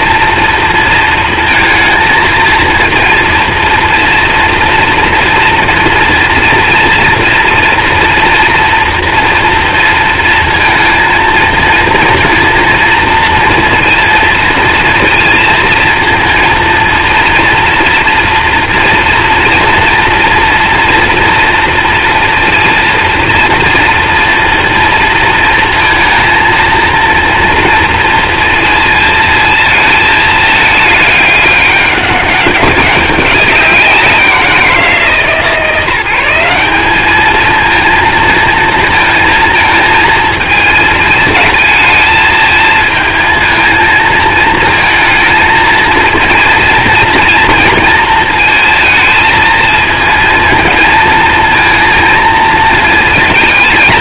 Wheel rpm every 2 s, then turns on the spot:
230, 230, 230, 230, 230, 220, 230, 230, 230, 240, 230, 240, 230, 230, 230, 210, 190, 170, 210, 220, 220, 220, 230, 230, 220, 230, 220.
none